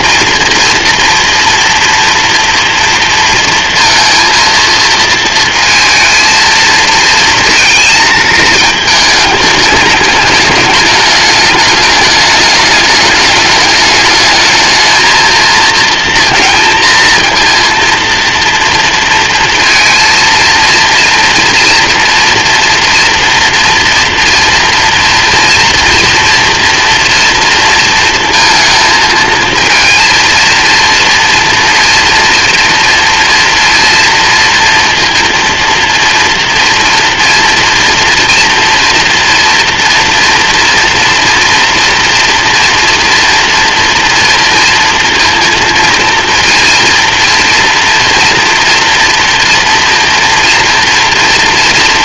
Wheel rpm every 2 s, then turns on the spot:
230, 230, 230, 230, 220, 210, 210, 220, 230, 230, 230, 240, 230, 240, 220, 230, 230, 230, 230, 230, 230, 230, 230, 230, 240, 230.
none